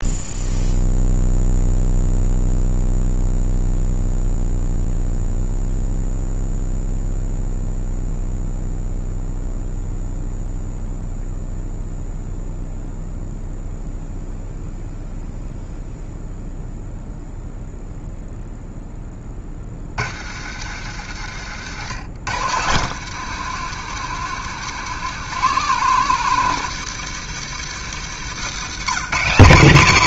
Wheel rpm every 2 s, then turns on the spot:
0, 0, 0, 0, 0, 0, 0, 0, 0, 10, 100, 140, 180, 180, 190.
none